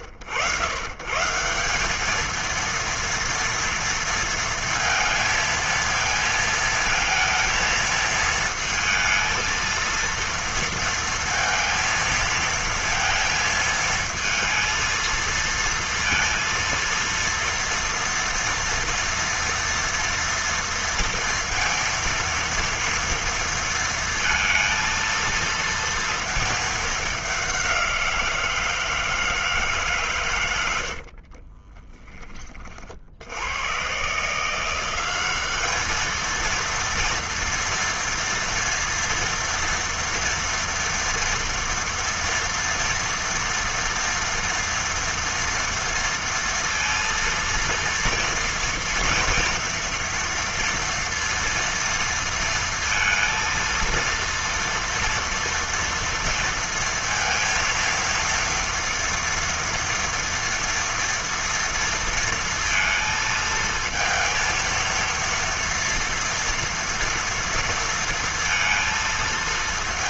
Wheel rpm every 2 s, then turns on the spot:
100, 220, 230, 230, 220, 230, 230, 220, 230, 240, 230, 230, 230, 220, 170, 130, 20, 150, 220, 230, 230, 230, 230, 230, 230, 230, 230, 230, 230, 230, 230, 230, 230, 230, 230.
none